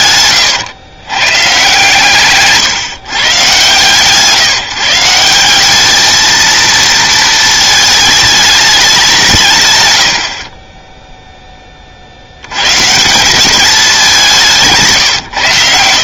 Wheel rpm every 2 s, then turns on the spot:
120, 150, 160, 230, 200, 20, 100, 160.
none